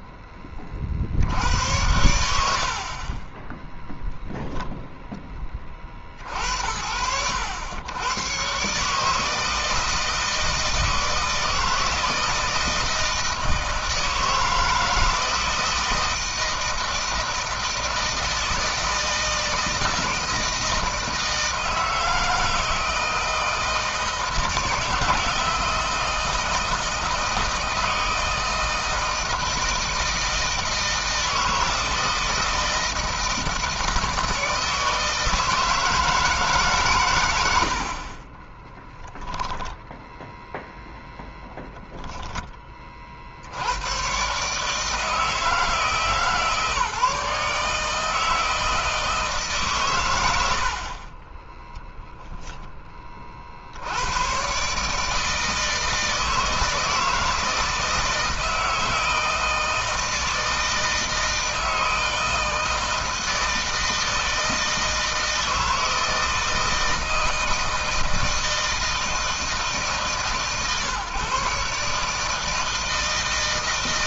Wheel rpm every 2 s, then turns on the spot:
30, 70, 0, 60, 140, 160, 160, 160, 160, 160, 160, 160, 160, 160, 160, 160, 160, 160, 150, 20, 0, 20, 140, 150, 160, 70, 20, 130, 160, 160, 160, 160, 160, 160, 160, 140, 160.
38-40